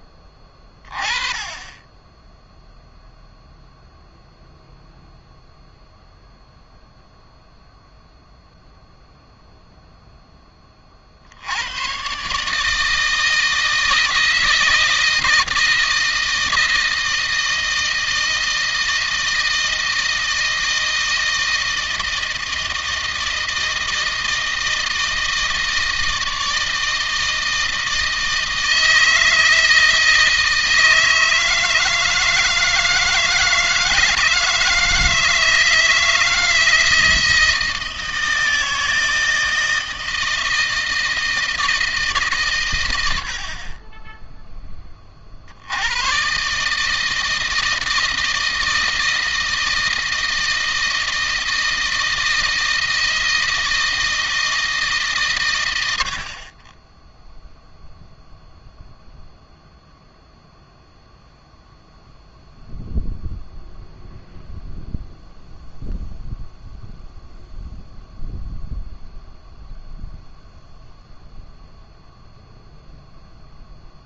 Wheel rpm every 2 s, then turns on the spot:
30, 0, 0, 0, 0, 40, 150, 160, 160, 160, 160, 160, 160, 160, 160, 160, 160, 160, 160, 160, 160, 100, 20, 150, 160, 160, 160, 150, 20, 0, 0, 0, 0, 0, 0, 0, 0.
none